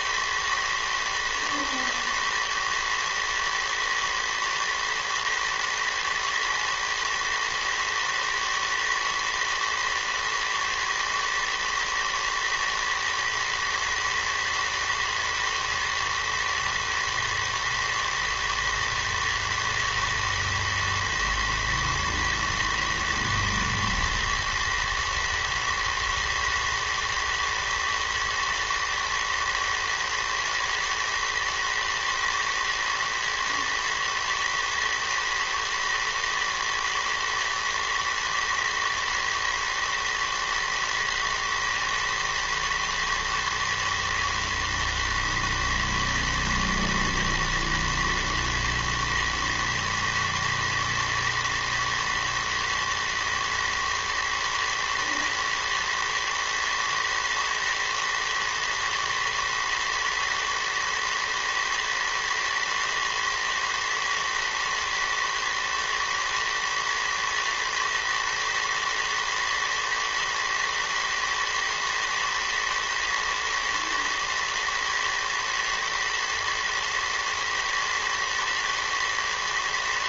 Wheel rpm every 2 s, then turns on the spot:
110, 110, 110, 110, 110, 110, 110, 110, 110, 110, 110, 110, 110, 110, 120, 110, 110, 110, 110, 120, 110, 120, 110, 110, 110, 110, 110, 110, 110, 110, 110, 110, 110, 110, 120, 110, 110, 110, 120, 110.
none